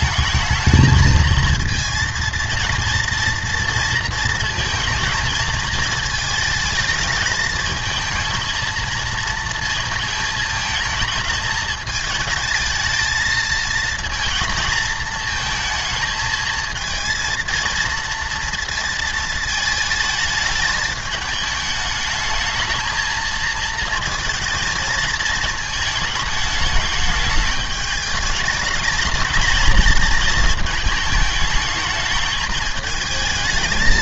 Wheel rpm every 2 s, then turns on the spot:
220, 230, 220, 220, 230, 220, 220, 230, 220, 230, 220, 220, 230, 210, 210, 220, 220.
none